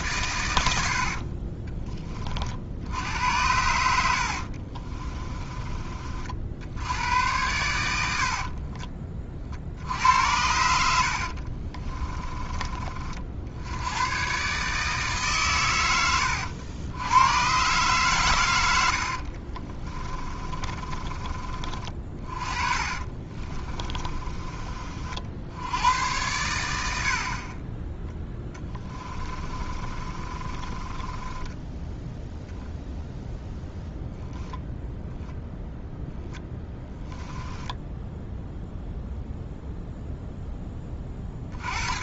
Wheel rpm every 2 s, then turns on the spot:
80, 70, 30, 80, 40, 80, 30, 150, 90, 80, 30, 30, 40, 70, 20, 20, 0, 0, 10, 0, 30.
4-6 10-12 18-24 28-32 36-38